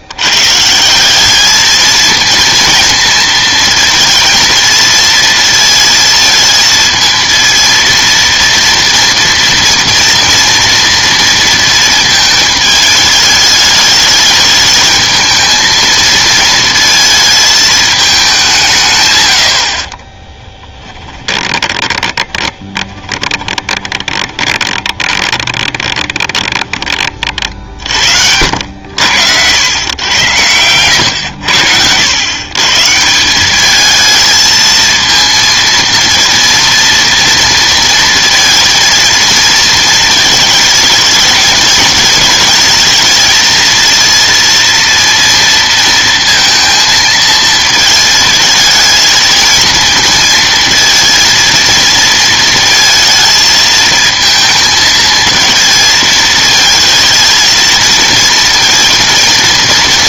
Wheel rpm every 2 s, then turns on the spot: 150, 230, 230, 220, 230, 230, 220, 210, 220, 180, 10, 30, 20, 20, 80, 100, 130, 220, 240, 230, 220, 220, 230, 230, 220, 230, 230, 220, 220, 230.
20-28